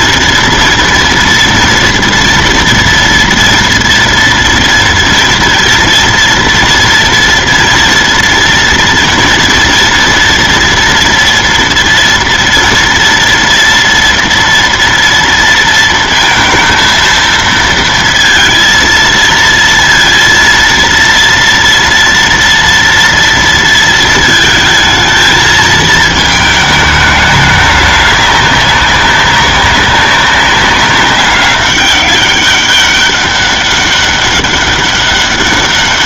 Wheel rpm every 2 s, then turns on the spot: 240, 230, 230, 230, 230, 230, 230, 230, 230, 230, 230, 230, 220, 210, 200, 190, 200, 200.
none